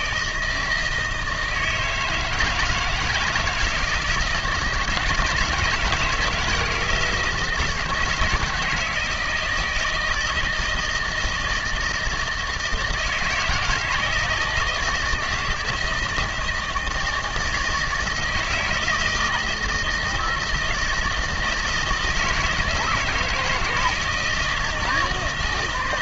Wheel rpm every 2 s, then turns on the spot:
160, 160, 160, 170, 160, 160, 160, 160, 160, 160, 160, 160, 160.
none